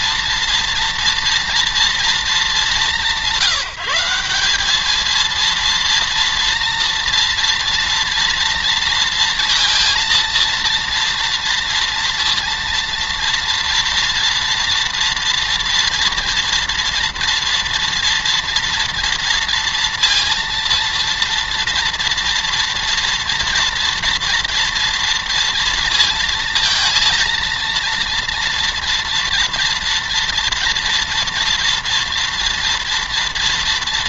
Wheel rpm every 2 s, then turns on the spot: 230, 190, 200, 240, 230, 230, 230, 230, 230, 230, 230, 230, 230, 230, 230, 230, 230.
none